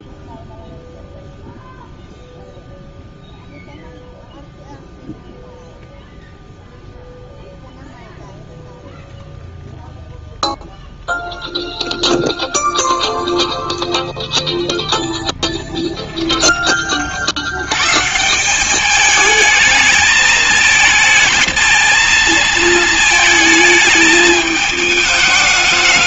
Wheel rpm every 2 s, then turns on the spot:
0, 0, 0, 0, 0, 0, 0, 0, 10, 170, 220, 220, 220.
none